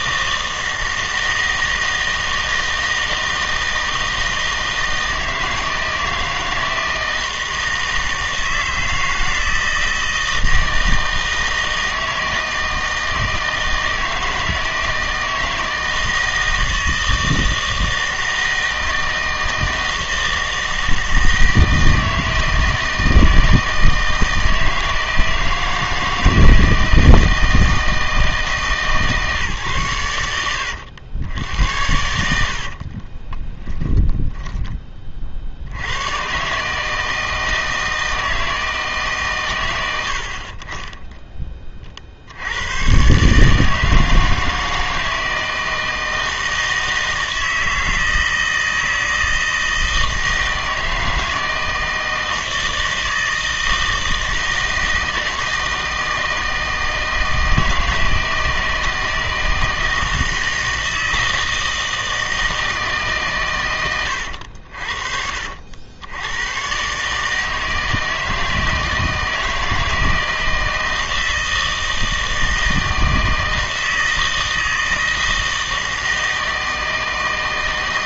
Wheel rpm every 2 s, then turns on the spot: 160, 160, 160, 160, 160, 160, 160, 160, 160, 160, 160, 160, 160, 160, 150, 100, 60, 20, 140, 160, 20, 100, 160, 160, 160, 160, 160, 160, 160, 160, 160, 160, 70, 120, 160, 160, 160, 160, 160.
32-36